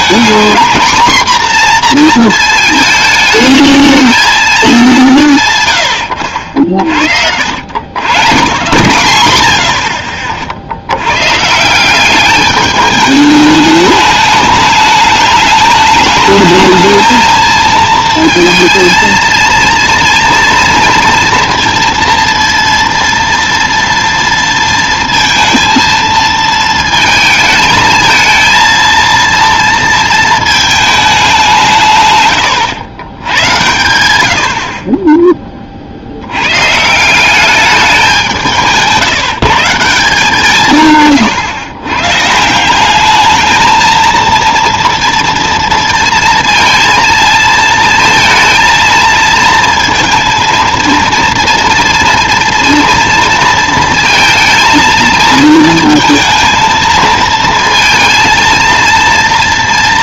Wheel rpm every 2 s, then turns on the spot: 230, 220, 210, 60, 140, 60, 210, 210, 220, 230, 230, 230, 230, 220, 230, 220, 120, 60, 130, 170, 150, 180, 230, 230, 230, 230, 230, 230, 230, 230.
none